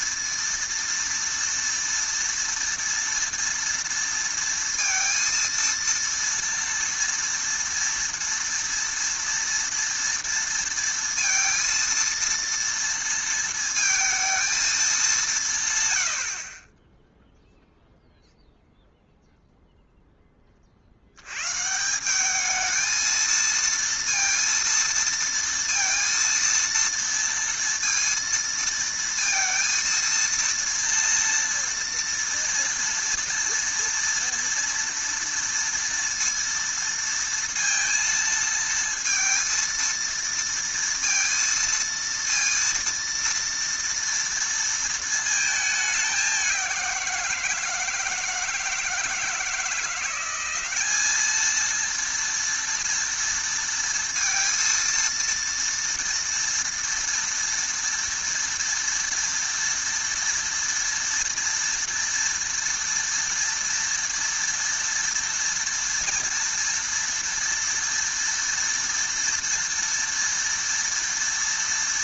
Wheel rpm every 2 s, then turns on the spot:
230, 230, 230, 230, 230, 230, 230, 220, 20, 0, 40, 220, 230, 230, 230, 230, 230, 230, 230, 230, 230, 230, 230, 180, 160, 190, 230, 230, 240, 240, 230, 230, 230, 230, 230, 230.
none